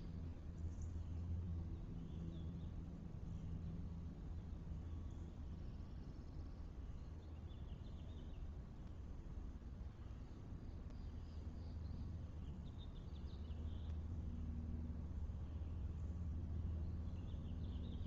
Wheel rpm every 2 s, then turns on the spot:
0, 0, 0, 0, 0, 0, 0, 0, 0.
none